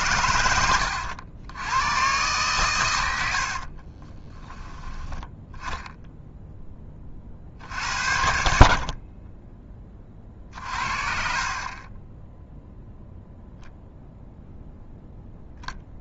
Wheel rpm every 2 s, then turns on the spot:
90, 120, 10, 10, 60, 50, 0, 0.
0-2 10-12